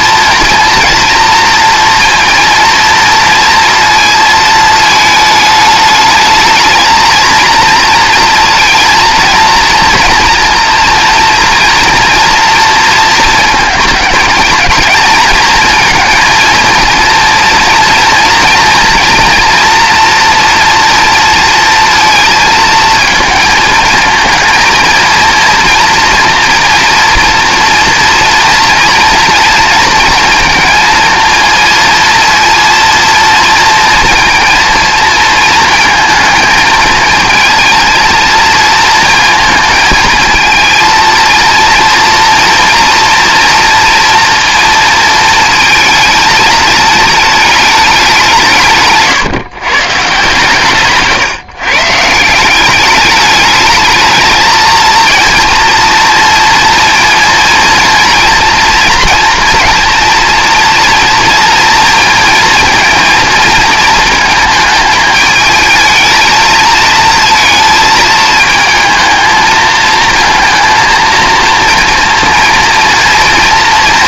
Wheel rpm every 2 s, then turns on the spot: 230, 230, 220, 220, 220, 230, 230, 220, 230, 230, 230, 230, 230, 230, 230, 220, 230, 230, 220, 230, 230, 230, 230, 210, 160, 140, 200, 230, 230, 230, 230, 230, 220, 220, 220, 230, 230.
50-52